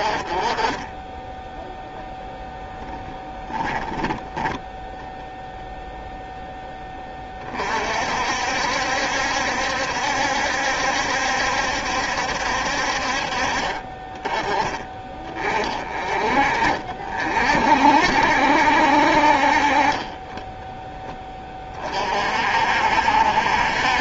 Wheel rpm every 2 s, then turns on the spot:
30, 10, 10, 10, 70, 70, 60, 20, 40, 60, 20, 60.
2-4